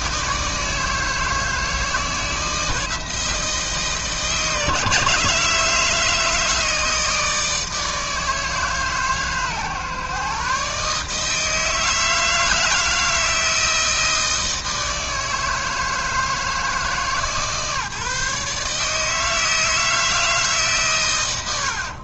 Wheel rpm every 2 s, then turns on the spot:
160, 160, 150, 160, 150, 150, 160, 160, 150, 150, 150.
none